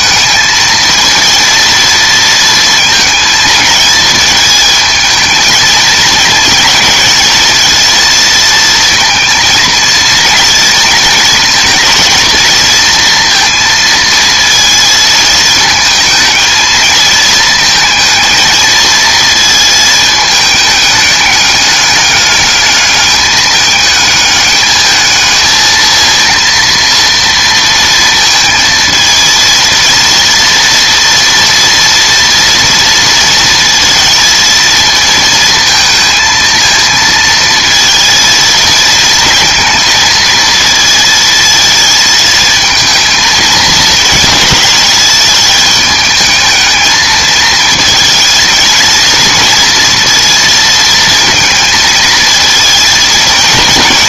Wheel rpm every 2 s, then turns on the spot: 220, 230, 220, 230, 230, 230, 230, 230, 220, 230, 210, 210, 210, 230, 230, 230, 230, 230, 230, 230, 220, 230, 210, 220, 230, 230, 230.
none